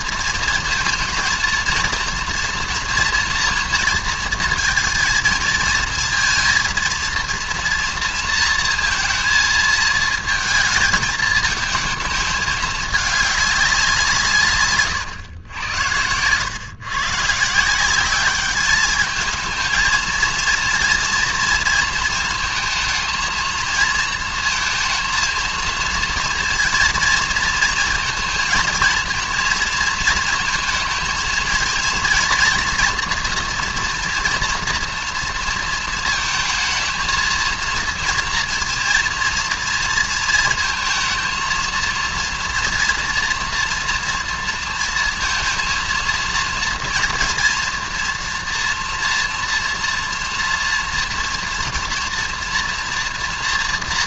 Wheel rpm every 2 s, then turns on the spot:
230, 240, 230, 230, 230, 220, 210, 130, 110, 210, 230, 220, 230, 230, 220, 230, 230, 230, 220, 230, 230, 240, 230, 230, 240, 230, 240.
none